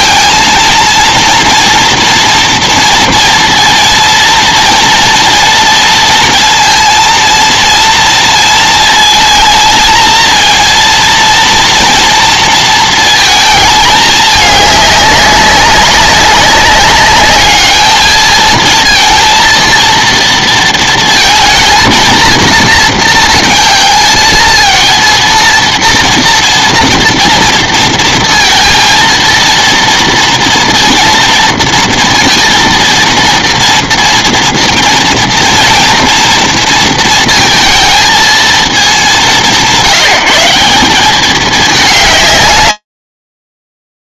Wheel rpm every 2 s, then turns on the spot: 230, 230, 230, 230, 230, 230, 230, 210, 200, 220, 230, 230, 220, 230, 230, 230, 230, 230, 230, 230, 170, 180.
none